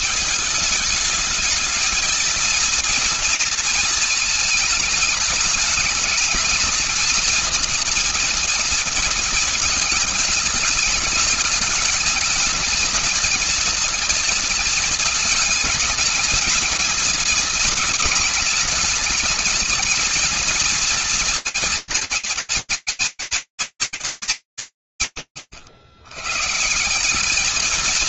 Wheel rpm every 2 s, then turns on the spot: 210, 230, 220, 220, 230, 210, 230, 220, 230, 210, 230, 210, 210, 120.
none